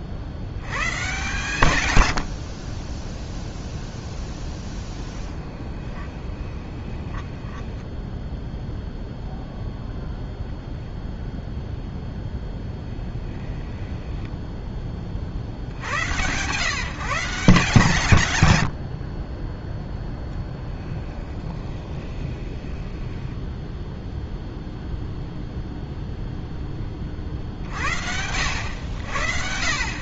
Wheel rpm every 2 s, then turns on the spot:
100, 10, 0, 20, 0, 0, 10, 10, 140, 110, 10, 20, 0, 10, 90.
6-8 12-14 20-24